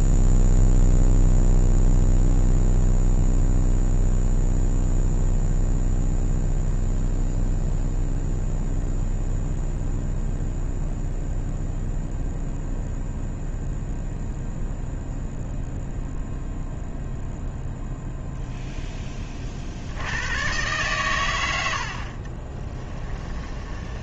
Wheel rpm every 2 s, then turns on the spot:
0, 0, 0, 0, 0, 0, 0, 0, 0, 0, 120, 20.
22-24